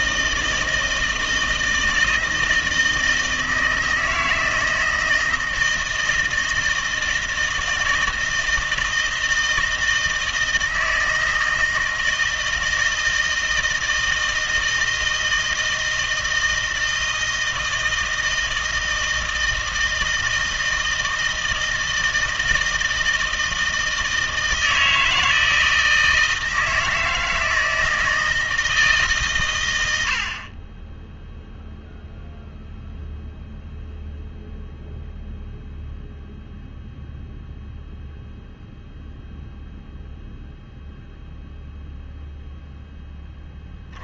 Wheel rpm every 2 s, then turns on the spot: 160, 160, 160, 160, 160, 160, 160, 160, 160, 160, 160, 160, 160, 160, 160, 30, 0, 0, 0, 0, 0, 0.
none